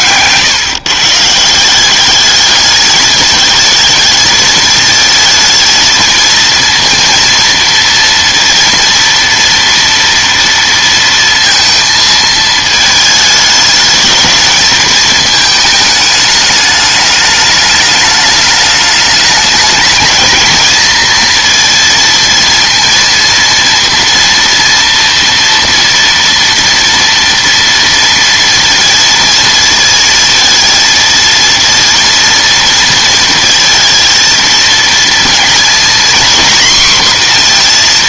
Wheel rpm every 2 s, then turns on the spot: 140, 210, 220, 230, 230, 230, 220, 220, 210, 210, 220, 230, 230, 230, 230, 230, 230, 230, 250.
none